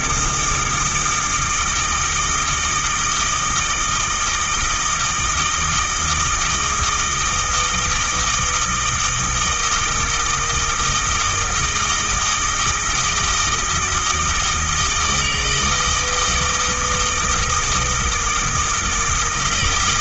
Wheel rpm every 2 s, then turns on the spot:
160, 160, 160, 160, 160, 160, 160, 160, 160, 160.
none